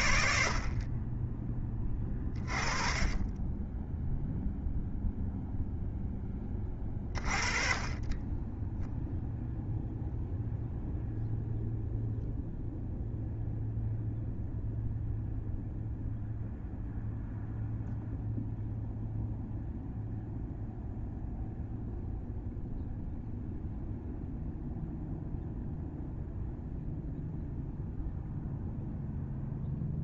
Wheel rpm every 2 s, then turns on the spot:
50, 30, 0, 20, 10, 0, 0, 0, 0, 0, 0, 0, 0, 0, 0.
none